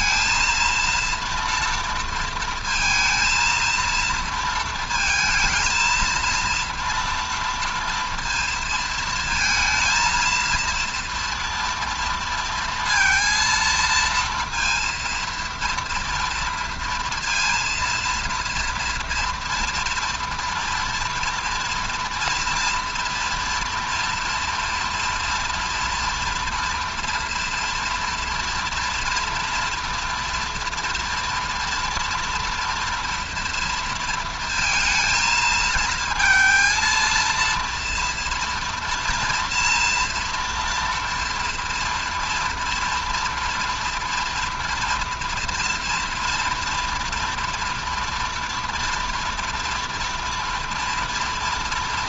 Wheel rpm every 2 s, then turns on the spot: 230, 230, 230, 230, 230, 230, 230, 230, 230, 230, 230, 230, 240, 230, 230, 230, 230, 230, 220, 230, 230, 230, 240, 230, 230, 230.
none